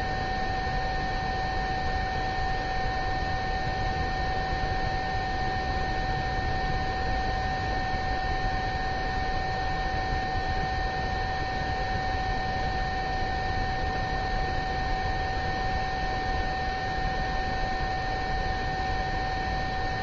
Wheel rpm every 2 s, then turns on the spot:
0, 0, 0, 0, 0, 0, 0, 0, 0, 0.
none